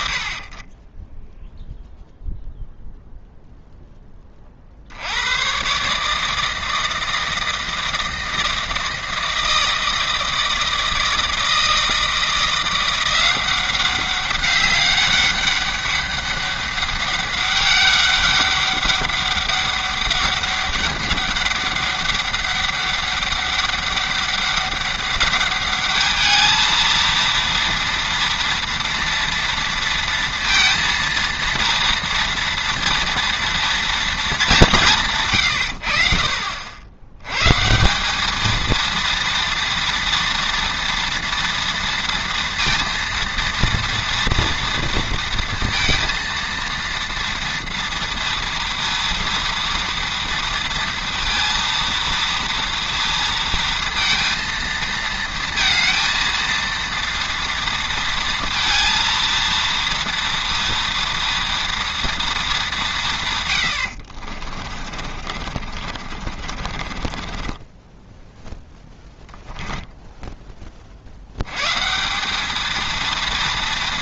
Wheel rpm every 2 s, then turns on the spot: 60, 0, 60, 160, 160, 160, 170, 200, 200, 190, 200, 200, 200, 220, 230, 230, 240, 180, 70, 230, 230, 230, 230, 230, 230, 230, 230, 230, 230, 230, 230, 190, 40, 30, 10, 30, 200.
64-70